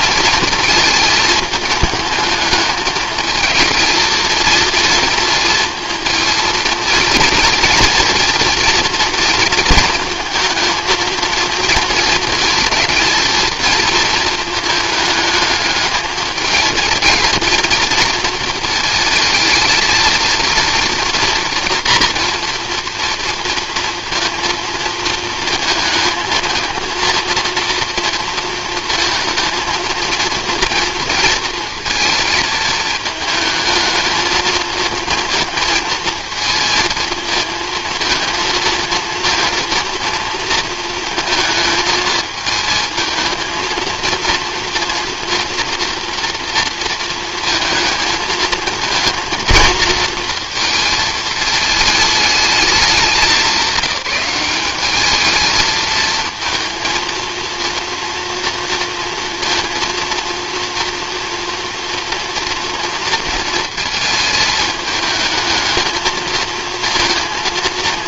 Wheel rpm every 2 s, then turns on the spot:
220, 220, 230, 230, 230, 230, 230, 210, 220, 230, 240, 240, 230, 230, 230, 230, 220, 230, 220, 230, 230, 220, 230, 230, 230, 230, 210, 210, 230, 230, 240, 230, 220, 230.
none